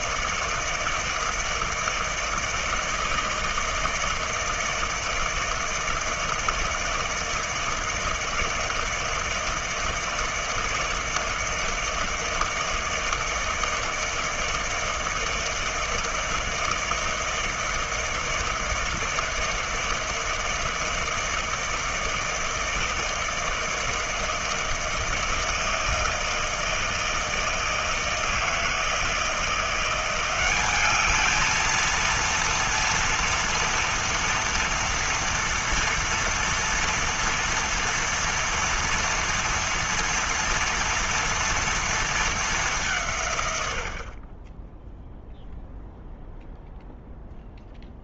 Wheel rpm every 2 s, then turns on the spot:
160, 160, 160, 160, 160, 160, 160, 160, 160, 160, 160, 160, 160, 160, 160, 190, 230, 230, 230, 230, 230, 200, 20, 0.
none